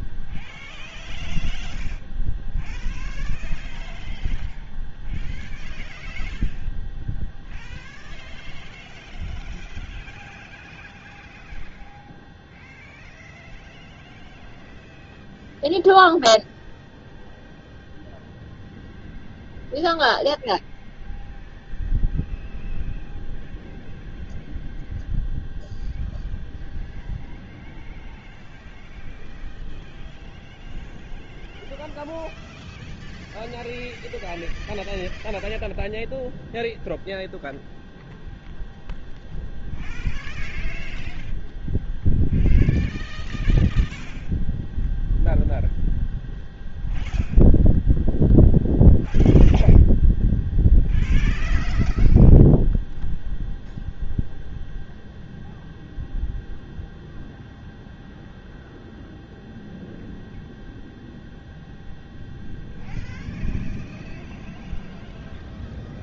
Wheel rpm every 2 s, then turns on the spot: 0, 0, 0, 0, 0, 0, 0, 0, 0, 0, 0, 0, 0, 0, 0, 0, 0, 0, 0, 0, 0, 0, 0, 0, 0, 0, 0, 0, 0, 0, 0, 0, 0.
none